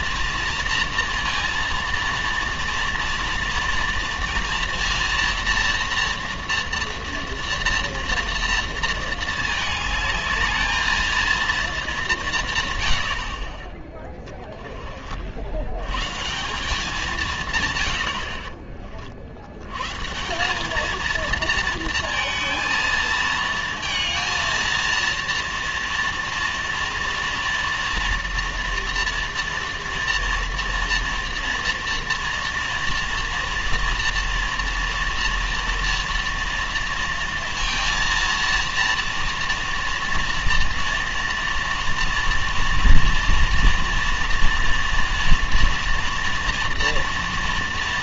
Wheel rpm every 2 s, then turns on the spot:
230, 230, 240, 230, 230, 220, 180, 10, 160, 90, 160, 230, 220, 230, 230, 230, 230, 230, 230, 230, 230, 230, 230, 230.
none